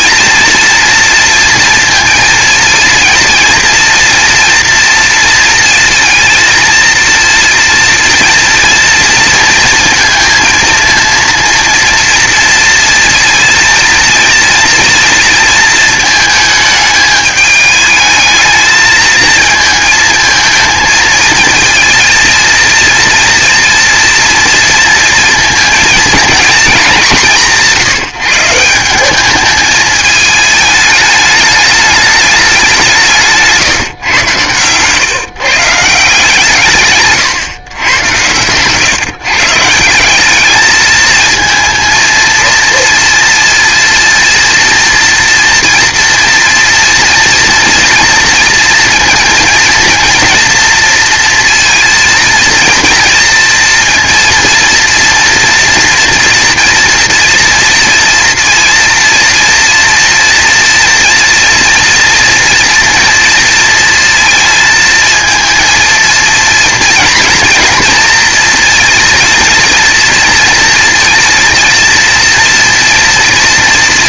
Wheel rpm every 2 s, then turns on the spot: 230, 230, 230, 230, 230, 230, 230, 230, 210, 220, 230, 230, 230, 210, 180, 210, 180, 130, 140, 130, 220, 230, 230, 230, 230, 230, 230, 230, 230, 230, 230, 230, 220, 230, 230, 230, 230.
none